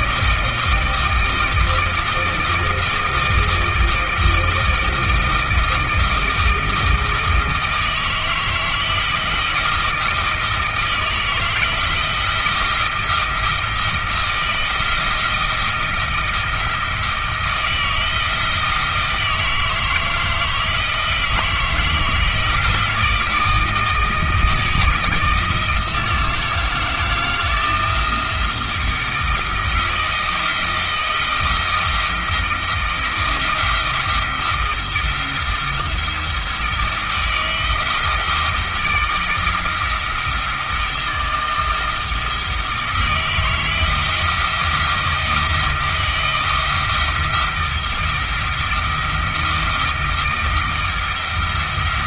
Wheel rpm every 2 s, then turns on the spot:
160, 160, 160, 160, 160, 160, 170, 170, 160, 160, 160, 160, 160, 160, 170, 170, 160, 170, 160, 160, 170, 160, 170, 160, 170, 160.
none